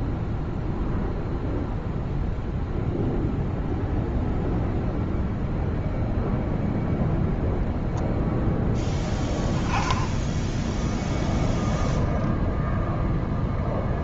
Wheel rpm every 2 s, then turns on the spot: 0, 0, 0, 0, 0, 10, 0.
none